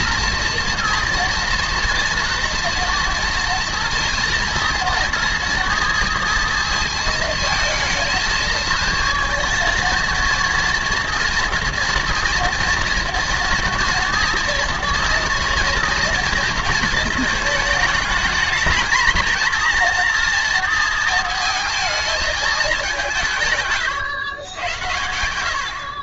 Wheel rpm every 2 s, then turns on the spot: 230, 230, 230, 230, 230, 230, 230, 230, 230, 220, 230, 210, 90.
24-26